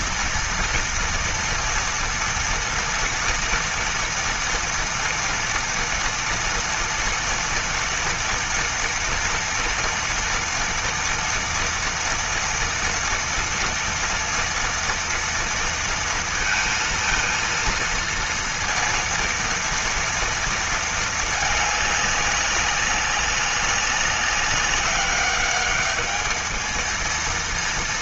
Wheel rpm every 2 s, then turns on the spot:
230, 230, 230, 230, 230, 230, 230, 230, 230, 230, 230, 200, 200, 220.
none